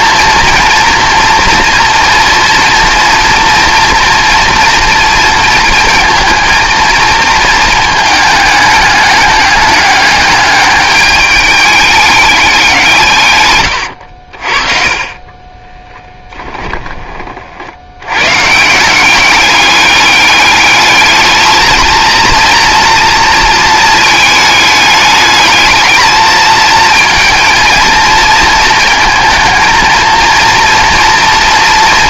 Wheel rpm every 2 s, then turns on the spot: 230, 230, 230, 230, 210, 210, 180, 40, 10, 160, 210, 230, 210, 220, 230, 230.
16-18